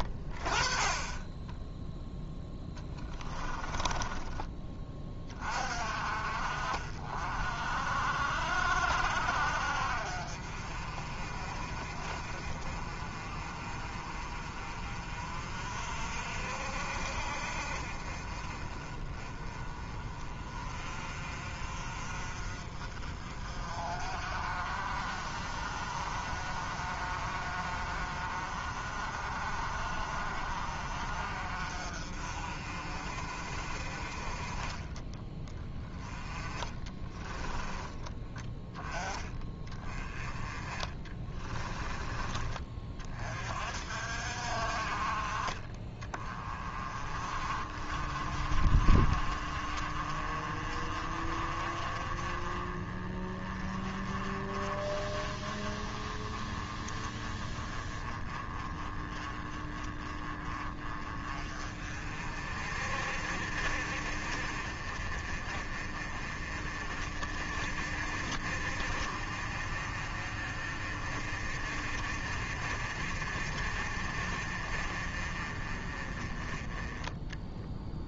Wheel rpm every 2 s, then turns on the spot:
20, 10, 20, 50, 70, 40, 40, 40, 50, 30, 40, 40, 40, 40, 40, 40, 50, 20, 20, 10, 20, 30, 40, 30, 30, 30, 20, 20, 20, 20, 30, 40, 40, 30, 50, 40, 40, 40, 10.
2-4 36-38 40-42